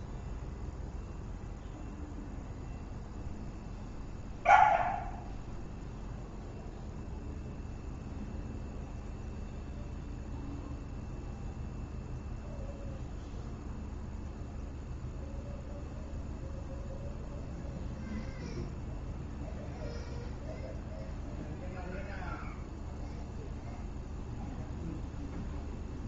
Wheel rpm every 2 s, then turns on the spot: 0, 0, 0, 0, 0, 0, 0, 0, 0, 0, 0, 0, 0.
none